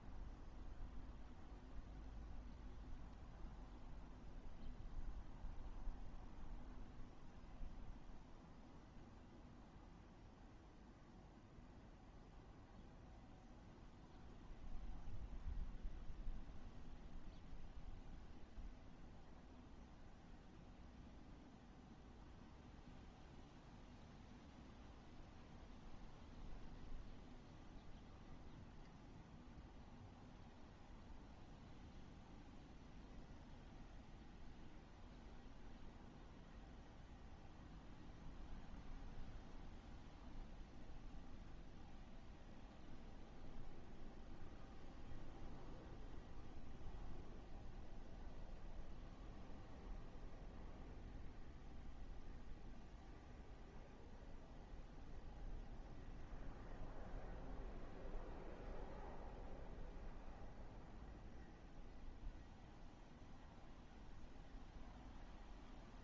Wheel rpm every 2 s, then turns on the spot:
0, 0, 0, 0, 0, 0, 0, 0, 0, 0, 0, 0, 0, 0, 0, 0, 0, 0, 0, 0, 0, 0, 0, 0, 0, 0, 0, 0, 0, 0, 0, 0, 0.
none